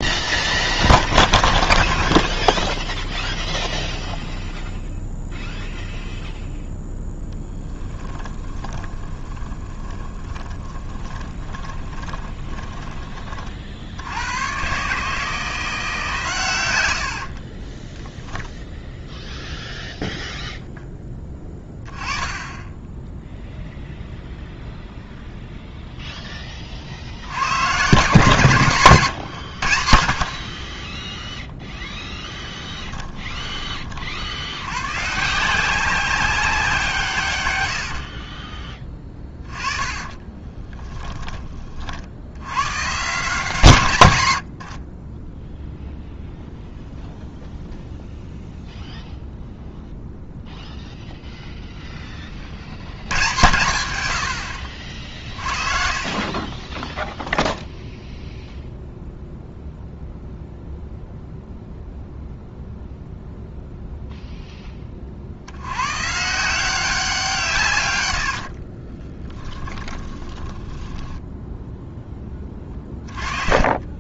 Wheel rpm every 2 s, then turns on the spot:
0, 0, 0, 0, 20, 10, 20, 130, 100, 0, 10, 10, 0, 40, 130, 20, 20, 110, 170, 20, 20, 130, 50, 0, 0, 0, 80, 50, 10, 0, 0, 0, 20, 180, 40, 10, 20.
8-12 28-30 32-34 38-42 44-46 54-58 68-74